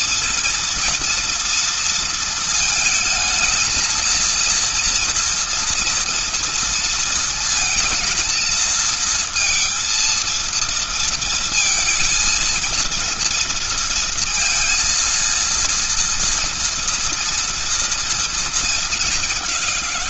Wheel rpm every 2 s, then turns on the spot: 230, 220, 230, 230, 230, 230, 230, 230, 230, 210.
none